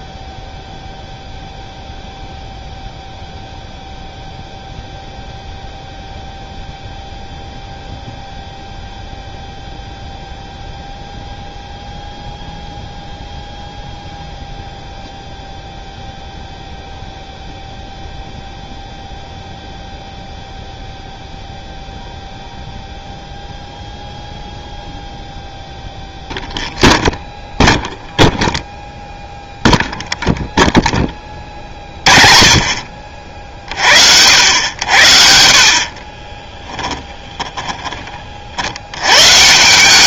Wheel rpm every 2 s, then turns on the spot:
0, 0, 0, 0, 0, 0, 0, 0, 0, 0, 0, 0, 0, 0, 0, 0, 30, 90, 20, 60.
36-38